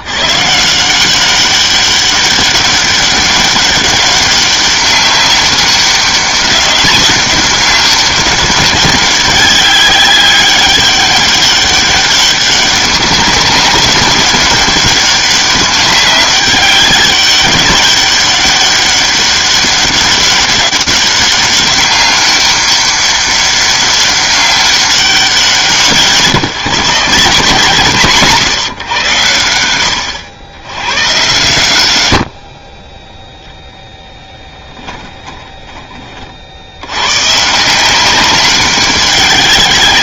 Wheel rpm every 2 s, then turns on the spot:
120, 200, 200, 200, 200, 200, 200, 200, 200, 200, 200, 200, 200, 170, 150, 110, 30, 20, 90, 190.
34-36